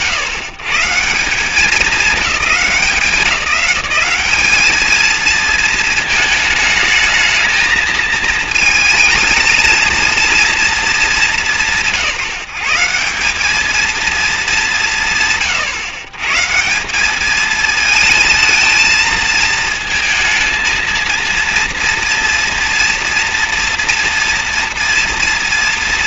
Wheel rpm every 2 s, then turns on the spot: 120, 200, 210, 220, 220, 230, 160, 200, 160, 220, 230, 230, 230.
none